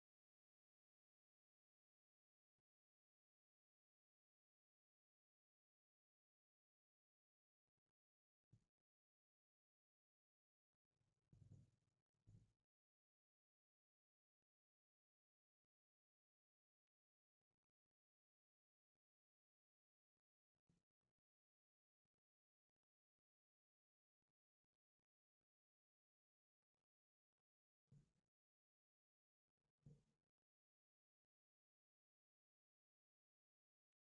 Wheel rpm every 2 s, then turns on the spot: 0, 0, 0, 0, 0, 0, 0, 0, 0, 0, 0, 0, 0, 0, 0, 0, 0.
none